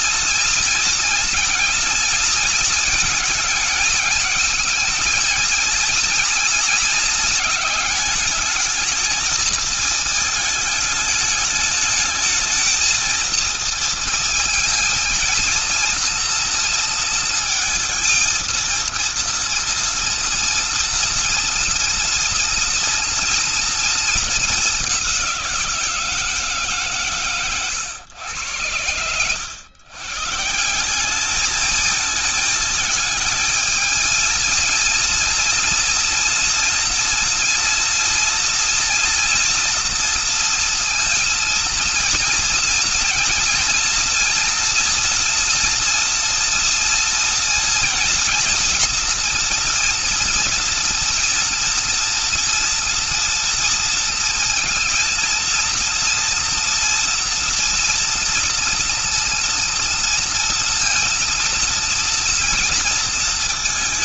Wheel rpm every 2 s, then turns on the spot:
230, 220, 220, 220, 220, 220, 230, 230, 230, 230, 230, 230, 190, 130, 90, 200, 220, 230, 230, 230, 230, 230, 230, 230, 230, 230, 230, 230, 230, 240, 230, 220.
26-28